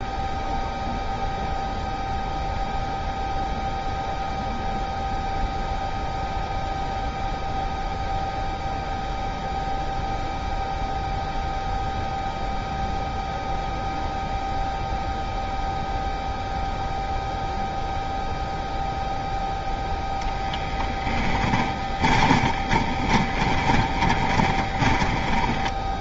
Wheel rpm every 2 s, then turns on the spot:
0, 0, 0, 0, 0, 0, 0, 0, 0, 0, 10, 10, 20.
22-26